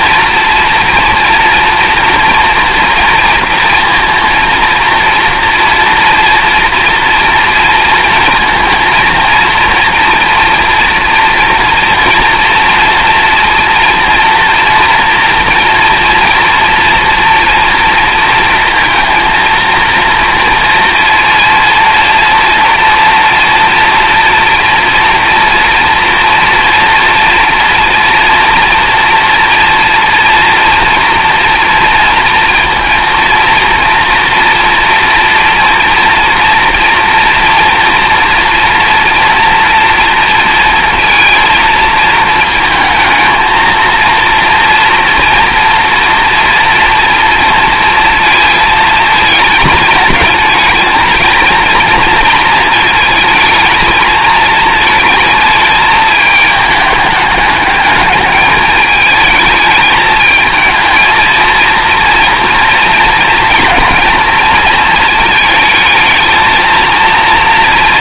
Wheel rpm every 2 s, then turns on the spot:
230, 230, 230, 230, 230, 230, 230, 230, 240, 230, 230, 230, 230, 230, 230, 240, 230, 230, 230, 230, 230, 220, 230, 230, 220, 220, 220, 220, 210, 210, 220, 230, 230, 220.
none